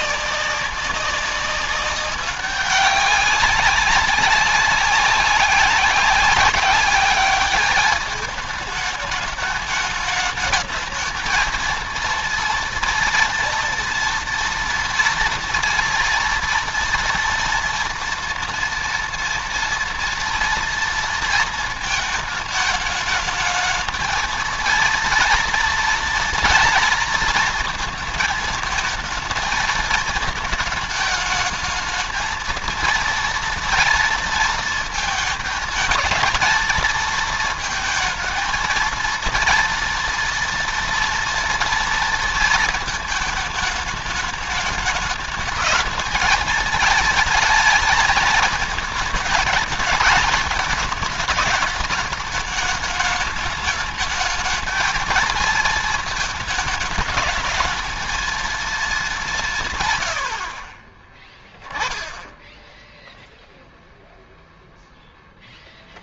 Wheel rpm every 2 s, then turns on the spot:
190, 190, 190, 190, 210, 220, 230, 230, 230, 230, 230, 220, 230, 230, 220, 220, 230, 220, 230, 230, 230, 220, 210, 220, 220, 210, 210, 220, 210, 210, 30, 0, 0.
60-62